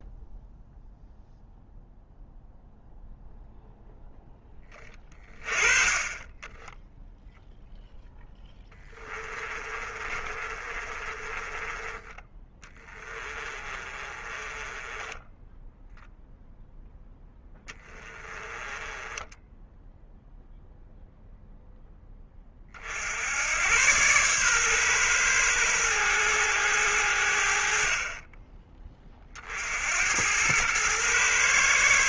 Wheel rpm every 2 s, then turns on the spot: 0, 0, 20, 10, 10, 30, 20, 20, 0, 10, 0, 40, 120, 90, 30, 100.
8-16 18-20